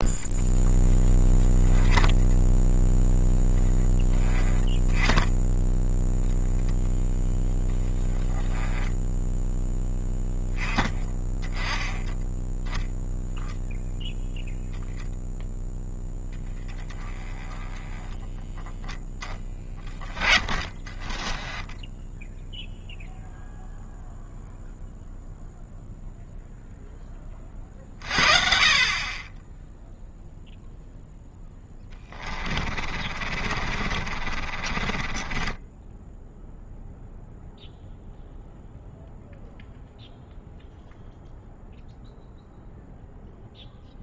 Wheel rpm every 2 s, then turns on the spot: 10, 0, 0, 0, 10, 10, 0, 0, 20, 10, 30, 0, 0, 0, 40, 0, 40, 30, 0, 0, 0, 0.
20-22 32-36